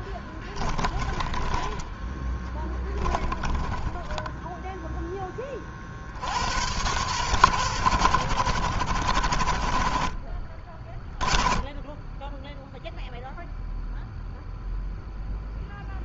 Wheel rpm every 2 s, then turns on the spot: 20, 20, 10, 100, 70, 20, 0, 0.
0-4